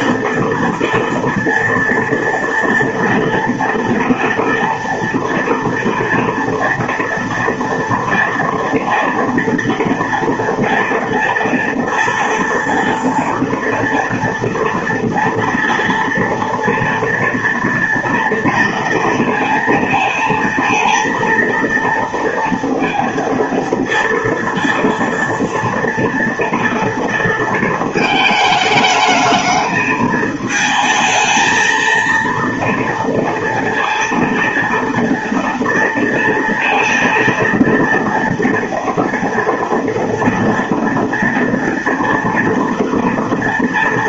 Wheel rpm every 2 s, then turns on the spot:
230, 230, 230, 230, 230, 240, 230, 230, 230, 230, 230, 230, 230, 230, 220, 220, 230, 230, 230, 230, 230, 230.
none